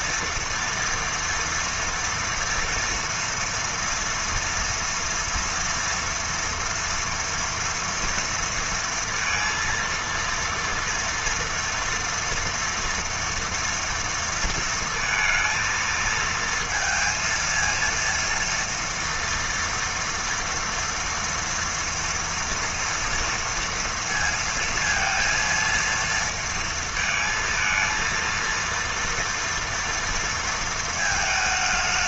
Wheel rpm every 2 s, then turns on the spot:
230, 230, 230, 230, 230, 230, 230, 230, 230, 230, 230, 230, 230, 230, 230, 220.
none